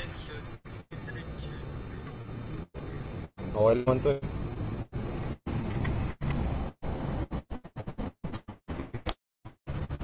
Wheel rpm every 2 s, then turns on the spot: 0, 0, 0, 0, 0.
none